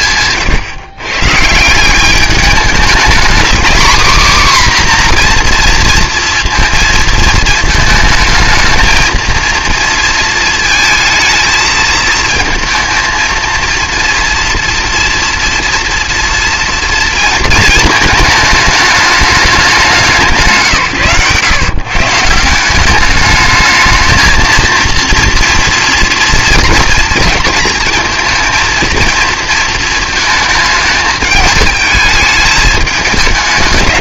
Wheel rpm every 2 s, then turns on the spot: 130, 210, 260, 230, 220, 220, 230, 230, 230, 210, 160, 180, 230, 230, 230, 210, 210.
none